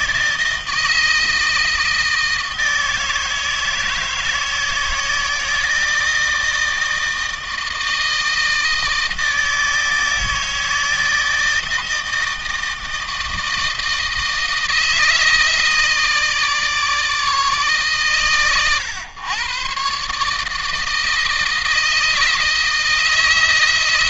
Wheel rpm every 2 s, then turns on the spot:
160, 160, 160, 160, 160, 160, 160, 160, 150, 110, 160, 160.
none